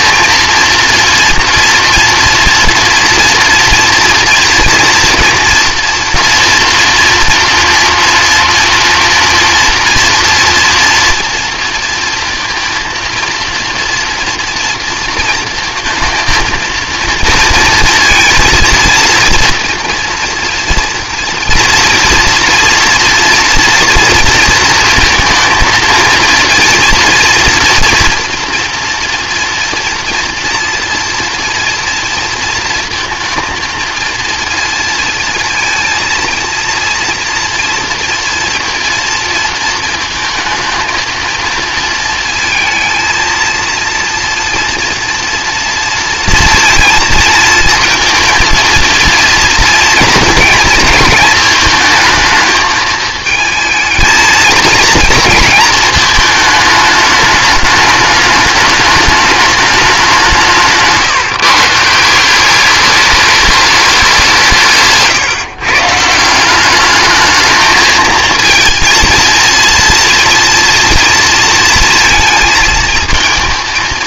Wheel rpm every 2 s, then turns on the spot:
230, 240, 240, 240, 230, 230, 230, 230, 230, 230, 230, 230, 230, 230, 230, 240, 230, 230, 230, 230, 220, 230, 240, 230, 230, 230, 220, 220, 220, 210, 160, 200, 150, 200, 230, 230, 220.
none